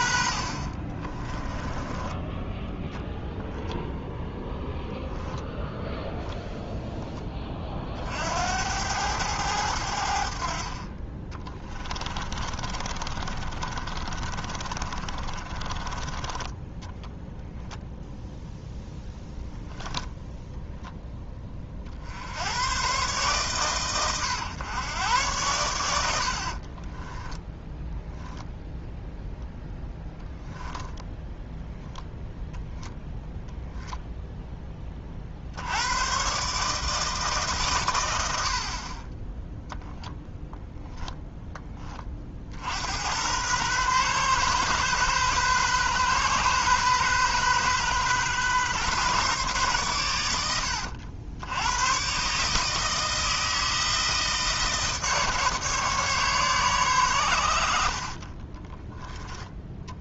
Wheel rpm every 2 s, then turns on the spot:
40, 10, 0, 0, 90, 50, 30, 40, 10, 0, 0, 110, 110, 30, 0, 10, 0, 10, 150, 50, 10, 70, 130, 130, 130, 80, 160, 160, 120, 10.
0-2 10-16 26-28 58-60